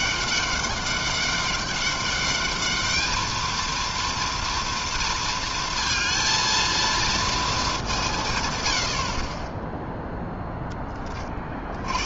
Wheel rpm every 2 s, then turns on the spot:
200, 220, 230, 220, 30, 50.
none